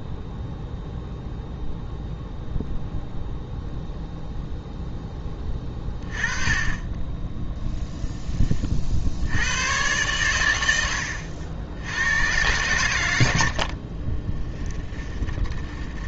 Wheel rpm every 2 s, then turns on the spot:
0, 0, 0, 10, 30, 100, 120, 20.
14-16